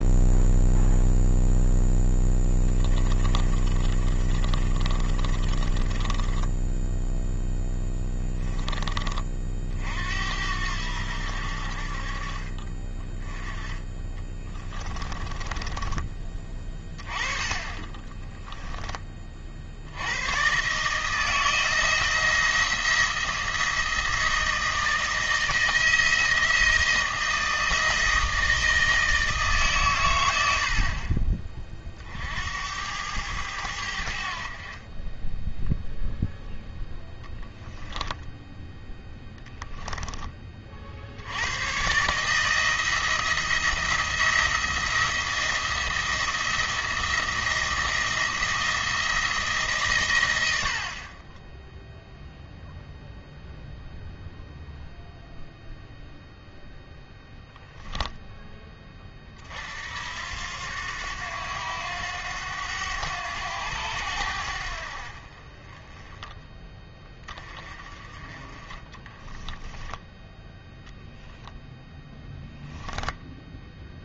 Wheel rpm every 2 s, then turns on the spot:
0, 10, 30, 10, 20, 80, 30, 20, 20, 10, 140, 170, 160, 160, 160, 50, 90, 30, 10, 10, 50, 160, 170, 170, 170, 60, 0, 0, 0, 20, 90, 90, 70, 20, 40, 10, 0.
2-8 14-16 68-70